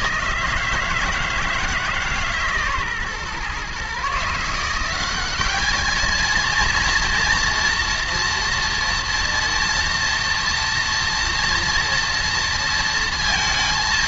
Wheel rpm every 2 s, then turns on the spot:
160, 140, 180, 230, 230, 230, 230.
none